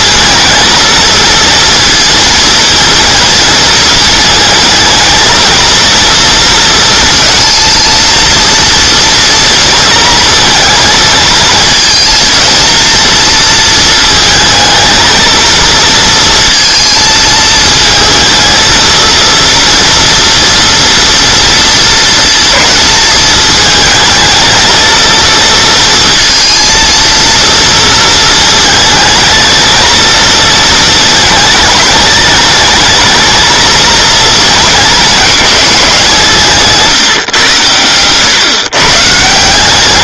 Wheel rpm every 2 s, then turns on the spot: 220, 220, 220, 230, 230, 220, 230, 220, 230, 230, 240, 220, 220, 230, 220, 220, 220, 210, 160, 140.
none